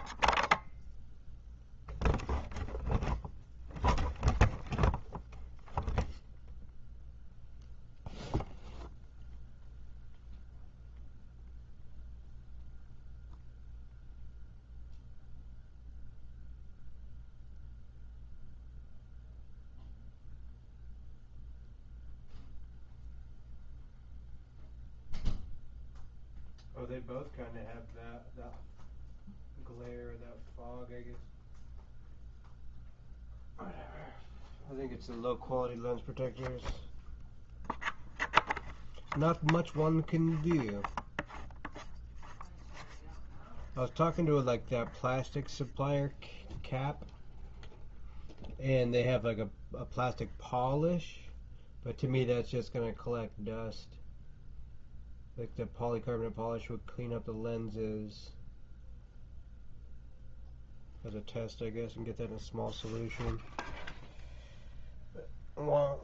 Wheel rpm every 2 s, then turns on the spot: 0, 0, 0, 0, 0, 0, 0, 0, 0, 0, 0, 0, 0, 0, 0, 0, 0, 0, 0, 0, 0, 0, 0, 0, 0, 0, 0, 0, 0, 0, 0, 0, 0.
none